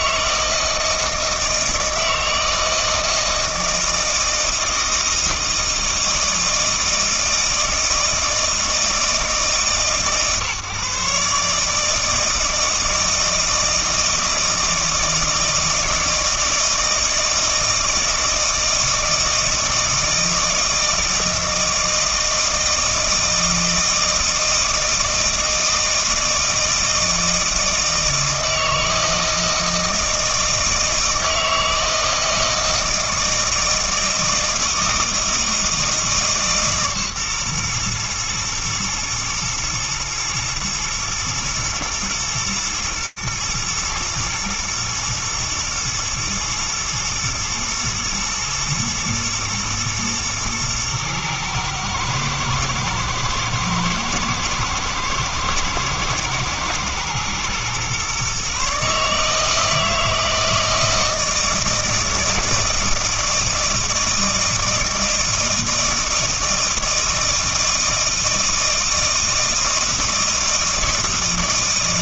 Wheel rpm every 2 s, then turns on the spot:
160, 160, 160, 160, 160, 140, 160, 160, 160, 160, 160, 160, 160, 160, 160, 160, 160, 160, 140, 120, 120, 120, 120, 110, 120, 110, 110, 110, 120, 140, 160, 160, 160, 160, 160, 160.
none